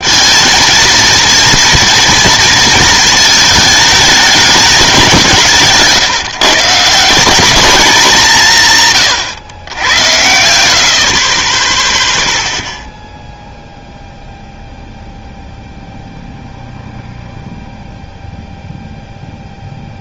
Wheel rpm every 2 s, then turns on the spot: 230, 230, 200, 150, 150, 60, 0, 0, 0, 0.
none